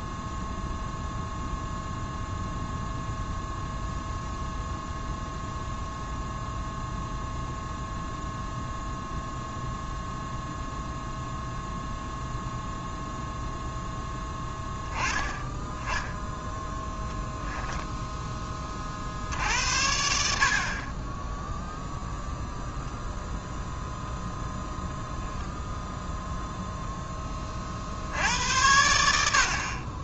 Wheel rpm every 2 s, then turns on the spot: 0, 0, 0, 0, 0, 0, 0, 10, 0, 30, 50, 0, 10, 0, 80.
none